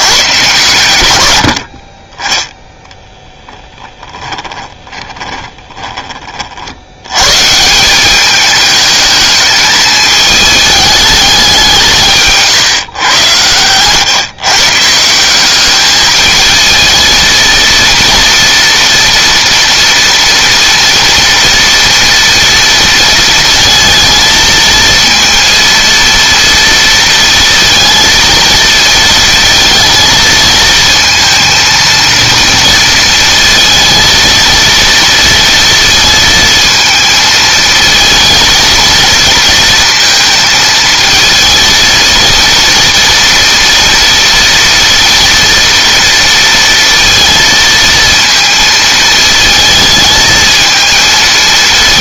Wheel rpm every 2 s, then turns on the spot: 90, 10, 20, 90, 210, 210, 130, 150, 220, 230, 230, 230, 230, 230, 230, 230, 230, 230, 220, 230, 220, 230, 230, 230, 230, 220.
4-6